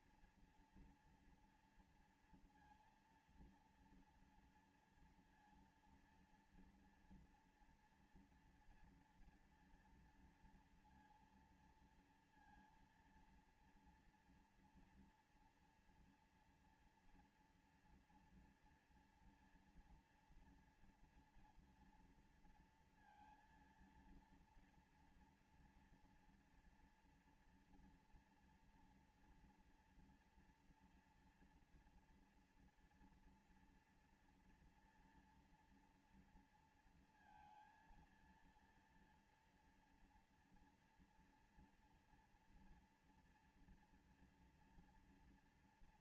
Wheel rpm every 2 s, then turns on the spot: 230, 230, 230, 240, 230, 230, 230, 230, 230, 230, 230, 230, 230, 240, 240, 240, 240, 240, 230, 230, 230, 230, 230.
none